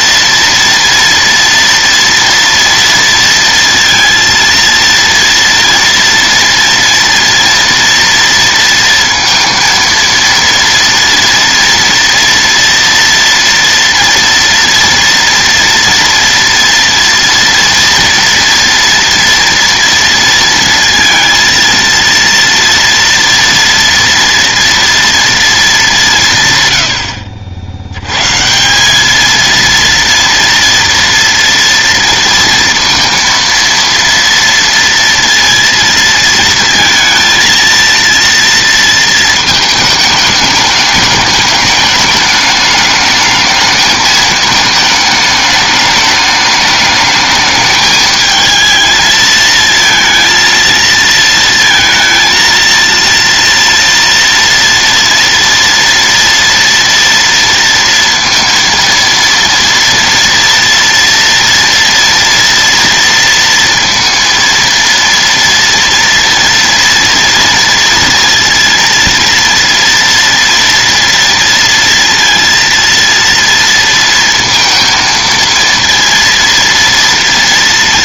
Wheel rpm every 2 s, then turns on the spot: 230, 230, 230, 230, 230, 230, 240, 230, 230, 230, 230, 230, 230, 110, 160, 230, 230, 230, 230, 230, 210, 210, 220, 210, 220, 230, 230, 230, 230, 230, 230, 230, 230, 230, 230, 230, 230, 230, 230.
none